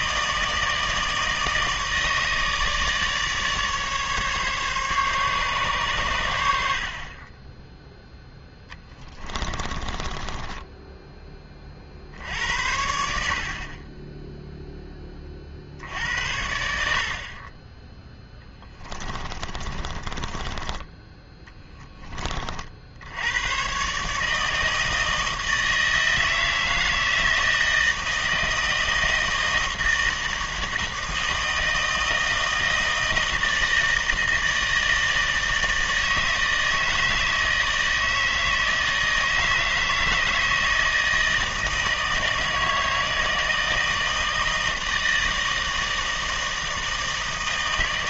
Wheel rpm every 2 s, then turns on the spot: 160, 150, 140, 60, 10, 10, 70, 10, 60, 20, 20, 70, 160, 160, 160, 160, 160, 160, 160, 160, 160, 160, 160, 160.
8-12 18-20